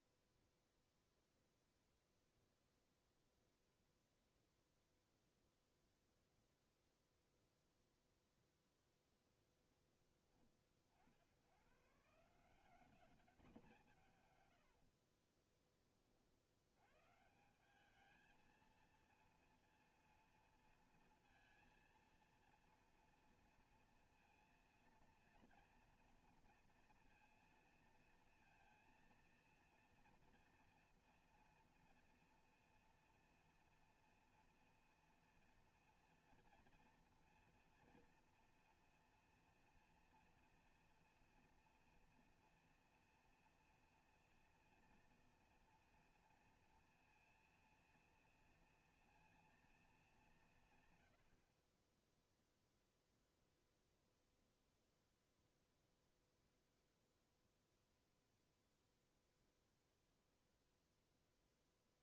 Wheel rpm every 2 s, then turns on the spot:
0, 0, 0, 0, 0, 70, 210, 50, 140, 230, 220, 230, 230, 230, 230, 240, 240, 230, 230, 240, 240, 240, 230, 230, 230, 90, 0, 0, 0, 0, 0.
14-16